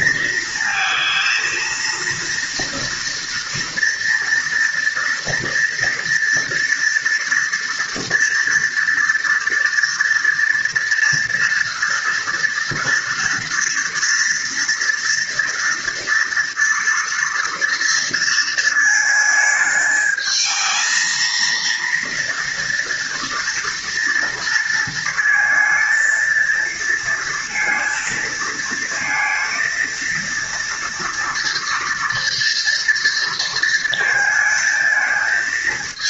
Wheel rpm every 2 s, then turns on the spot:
230, 230, 230, 230, 240, 230, 230, 230, 240, 220, 220, 230, 230, 230, 230, 230, 230, 220.
none